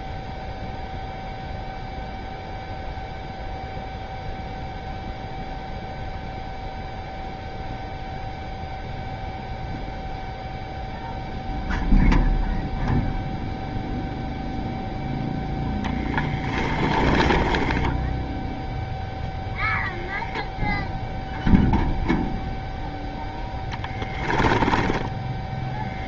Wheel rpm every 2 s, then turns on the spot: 0, 0, 0, 0, 0, 0, 0, 0, 20, 0, 0, 0, 10.
16-18 24-26